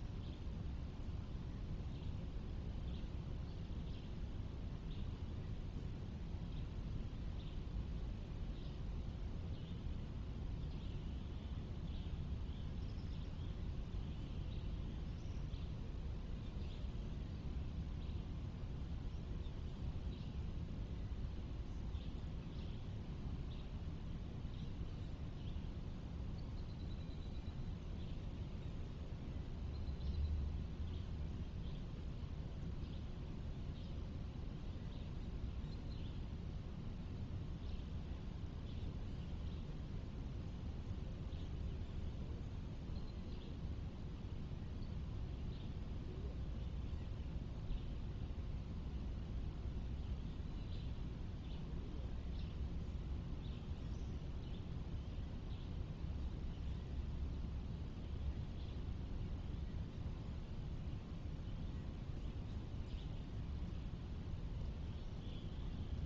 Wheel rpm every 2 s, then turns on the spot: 0, 0, 0, 0, 0, 0, 0, 0, 0, 0, 0, 0, 0, 0, 0, 0, 0, 0, 0, 0, 0, 0, 0, 0, 0, 0, 0, 0, 0, 0, 0, 0, 0.
none